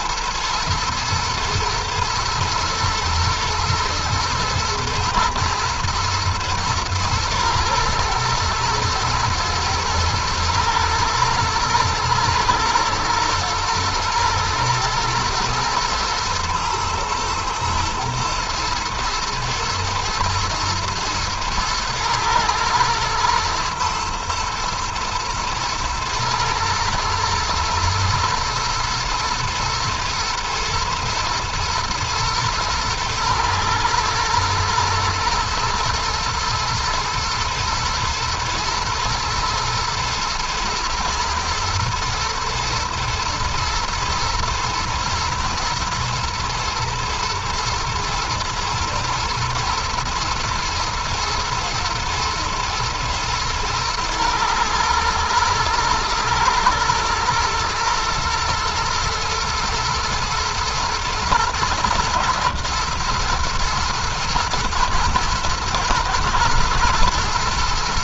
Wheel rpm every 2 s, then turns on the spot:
110, 110, 120, 120, 110, 120, 110, 120, 120, 110, 110, 120, 110, 110, 110, 110, 110, 110, 120, 120, 110, 120, 120, 120, 120, 120, 110, 110, 110, 120, 120, 120, 110, 120.
none